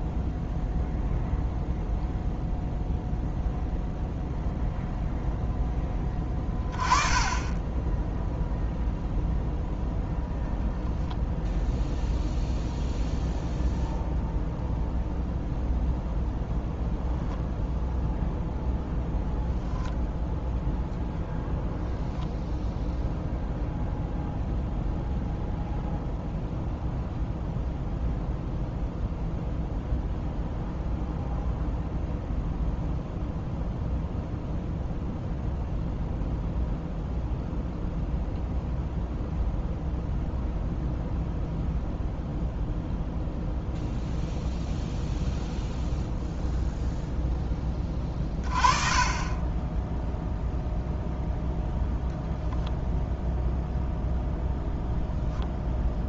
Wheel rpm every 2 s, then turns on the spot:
0, 0, 0, 10, 0, 0, 0, 0, 0, 0, 0, 0, 0, 0, 0, 0, 0, 0, 0, 0, 0, 0, 0, 0, 30, 0, 0, 0.
none